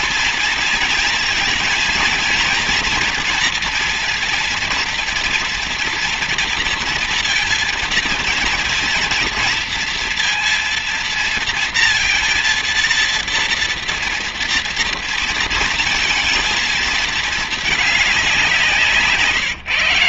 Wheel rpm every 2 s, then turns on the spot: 230, 230, 230, 230, 230, 230, 230, 230, 230, 180.
none